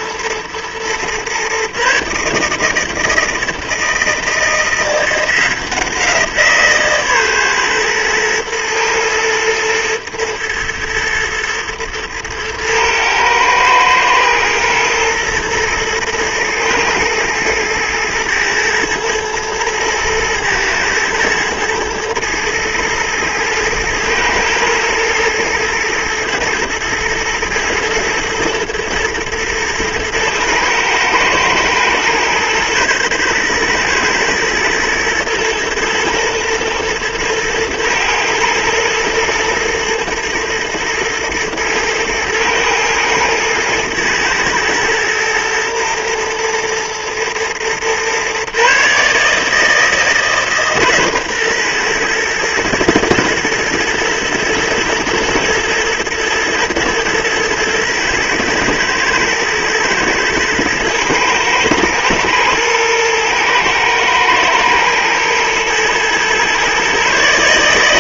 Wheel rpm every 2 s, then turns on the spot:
120, 160, 170, 150, 120, 110, 110, 110, 110, 110, 110, 110, 110, 110, 110, 120, 120, 120, 120, 110, 110, 110, 110, 120, 140, 140, 110, 110, 110, 120, 120, 110, 110, 140.
none